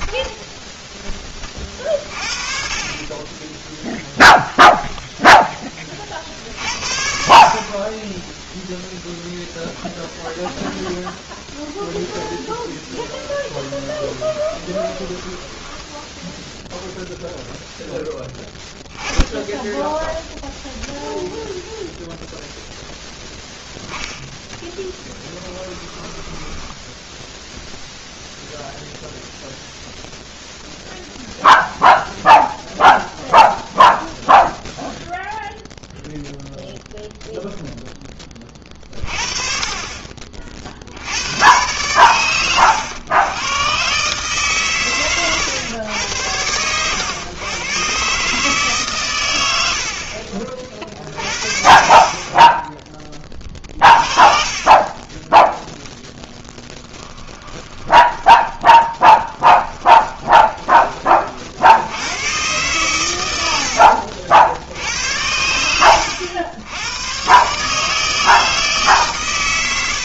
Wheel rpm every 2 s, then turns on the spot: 30, 30, 10, 30, 0, 0, 10, 10, 0, 10, 0, 0, 20, 0, 0, 0, 0, 0, 0, 40, 90, 110, 120, 110, 110, 50, 20, 20, 20, 20, 20, 120, 80, 110, 140.
2-4 12-16 24-26 50-52 54-60